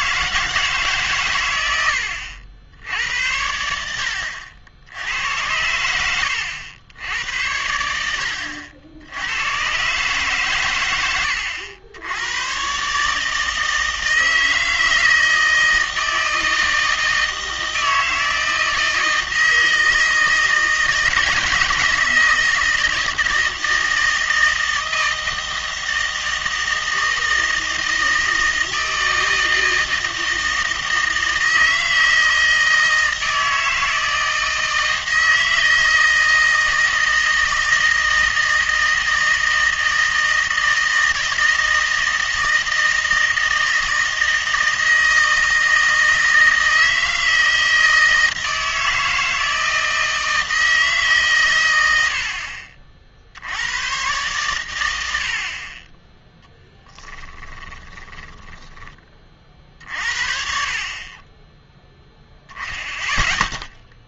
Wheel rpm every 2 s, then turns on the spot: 160, 80, 70, 80, 70, 110, 130, 160, 160, 160, 160, 160, 160, 160, 160, 160, 160, 160, 160, 160, 160, 160, 160, 160, 160, 160, 50, 110, 10, 10, 50, 0.
56-58